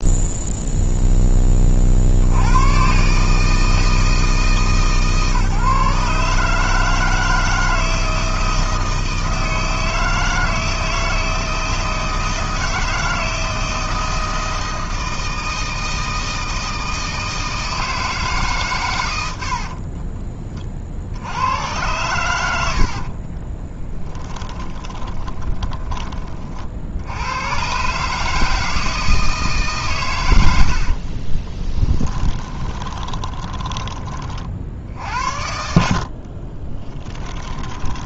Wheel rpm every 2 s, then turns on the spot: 0, 130, 150, 160, 160, 160, 160, 160, 160, 120, 50, 60, 20, 70, 160, 50, 20, 60, 20.
22-26 30-34 36-38